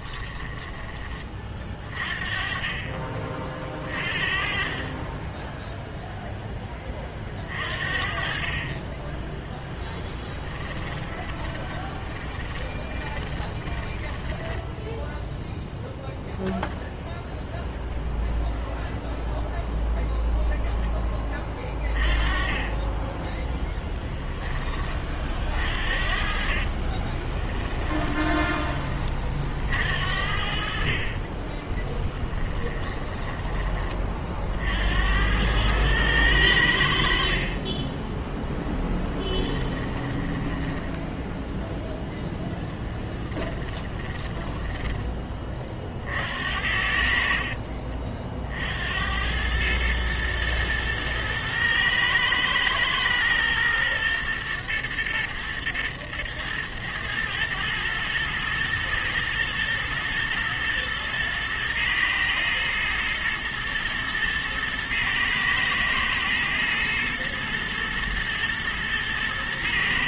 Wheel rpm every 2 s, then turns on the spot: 20, 30, 30, 10, 30, 20, 20, 10, 0, 0, 10, 20, 30, 30, 20, 50, 20, 60, 80, 10, 10, 10, 10, 60, 70, 110, 110, 120, 110, 110, 120, 110, 110, 120, 110.
0-2 8-16 26-28 32-34 38-42 44-46